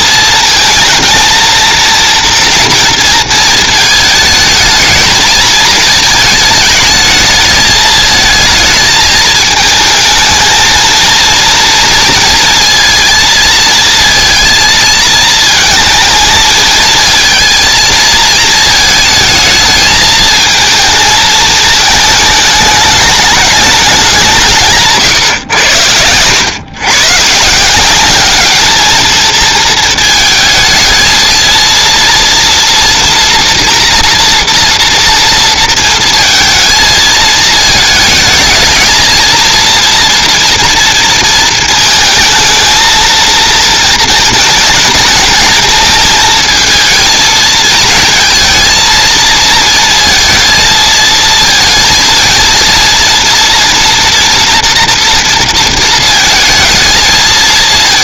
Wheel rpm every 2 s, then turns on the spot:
230, 230, 210, 220, 220, 220, 230, 230, 220, 220, 220, 210, 150, 110, 210, 220, 230, 230, 220, 220, 230, 220, 220, 220, 230, 230, 230, 230, 220.
none